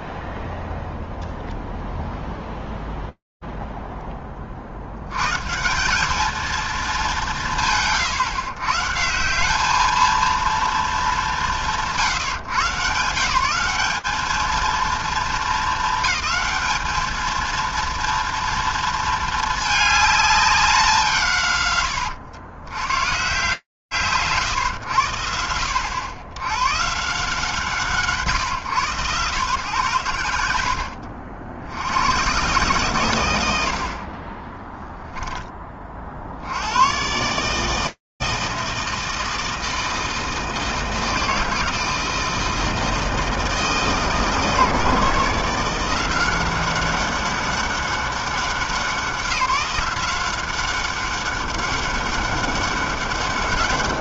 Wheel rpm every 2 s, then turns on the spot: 0, 0, 70, 220, 160, 220, 140, 220, 220, 230, 200, 80, 110, 90, 140, 90, 130, 10, 70, 160, 160, 160, 150, 190, 190, 190, 200.
none